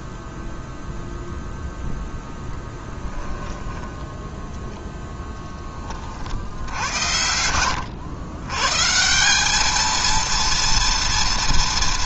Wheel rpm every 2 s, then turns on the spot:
0, 10, 10, 80, 130, 230.
2-4